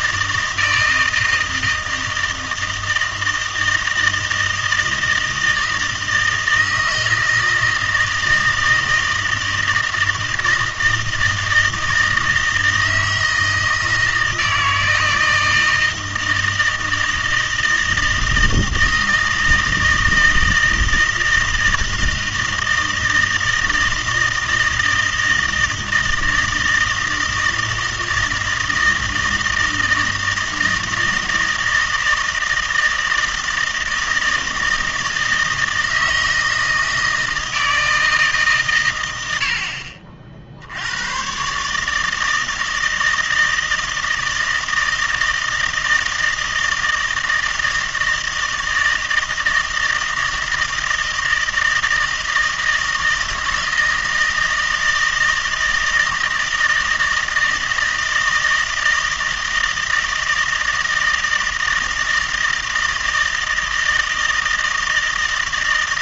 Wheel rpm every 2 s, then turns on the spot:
160, 160, 160, 160, 160, 160, 160, 160, 160, 160, 160, 160, 160, 160, 160, 160, 160, 160, 160, 140, 70, 160, 160, 160, 160, 160, 160, 160, 160, 160, 160, 160, 160.
none